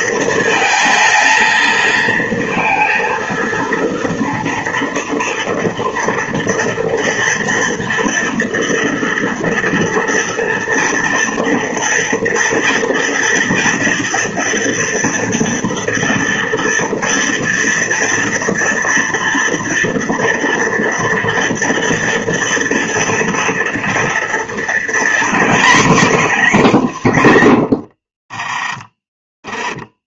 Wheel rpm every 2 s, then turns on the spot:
230, 230, 230, 230, 230, 230, 240, 230, 230, 240, 230, 230, 230, 250, 30.
28-30